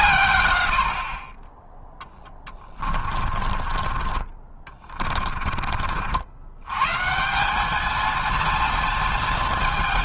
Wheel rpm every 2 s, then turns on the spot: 100, 20, 30, 110, 230.
2-6